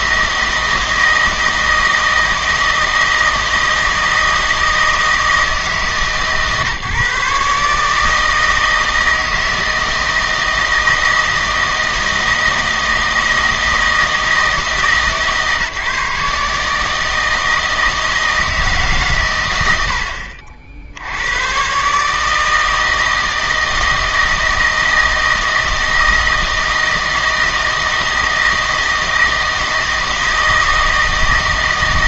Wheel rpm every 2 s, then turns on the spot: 160, 160, 160, 140, 160, 160, 160, 150, 150, 150, 70, 160, 160, 160, 160, 160.
none